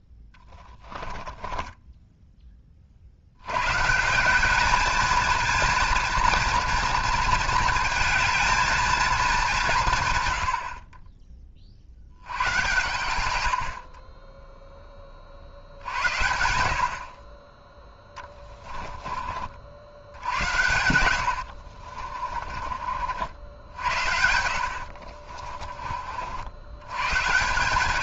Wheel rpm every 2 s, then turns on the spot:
10, 20, 200, 230, 230, 60, 110, 10, 60, 30, 80, 40, 60, 100.
0-2 18-22 24-26